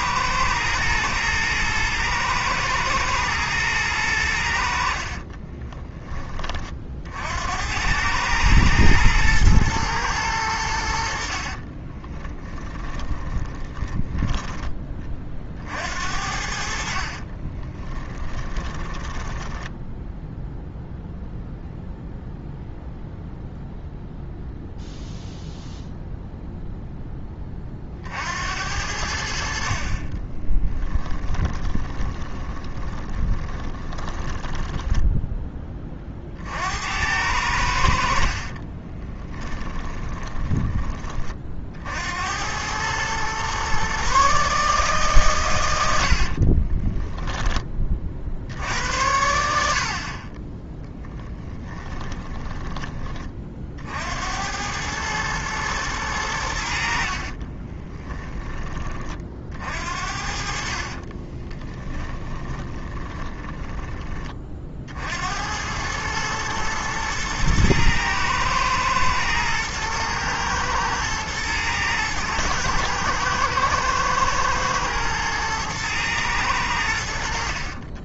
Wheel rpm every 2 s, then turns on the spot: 110, 110, 60, 50, 110, 70, 20, 20, 60, 20, 0, 0, 0, 0, 70, 10, 20, 10, 80, 30, 20, 110, 140, 20, 70, 10, 20, 100, 60, 20, 40, 20, 50, 110, 110, 110, 120, 120, 90.
12-14 16-20 30-34 38-40 46-48 56-58 60-64